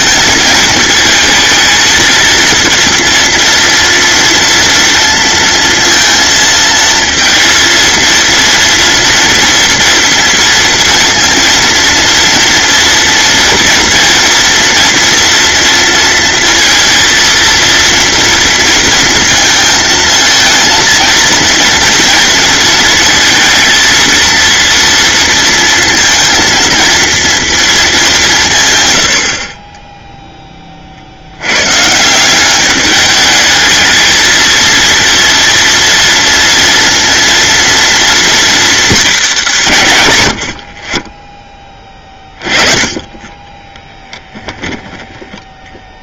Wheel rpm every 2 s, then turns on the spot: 230, 230, 230, 230, 230, 230, 230, 240, 230, 230, 230, 230, 230, 230, 110, 40, 210, 230, 230, 220, 30, 20, 10.
none